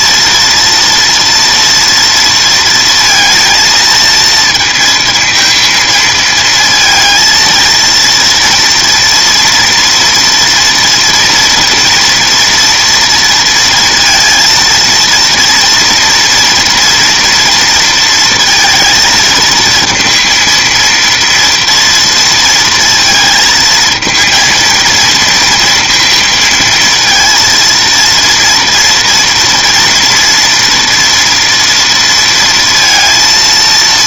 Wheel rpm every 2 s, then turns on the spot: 230, 230, 230, 230, 230, 230, 230, 230, 230, 220, 230, 230, 230, 230, 230, 230, 230.
none